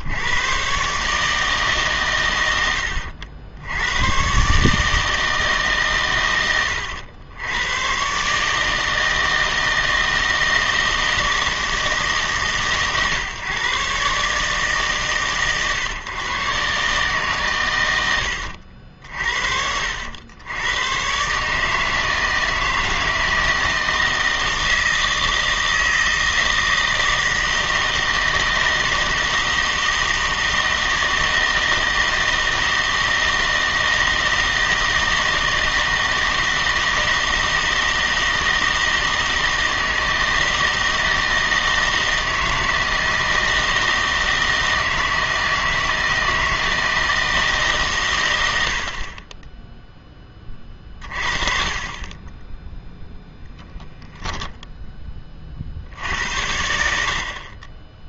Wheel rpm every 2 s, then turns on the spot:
120, 90, 140, 90, 150, 160, 120, 150, 140, 80, 110, 160, 160, 160, 160, 160, 160, 160, 160, 160, 160, 160, 160, 160, 60, 30, 10, 10, 70.
none